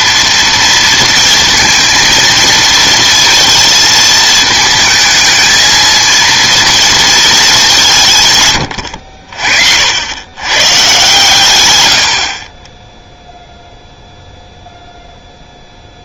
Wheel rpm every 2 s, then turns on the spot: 230, 220, 220, 230, 120, 130, 20, 0.
none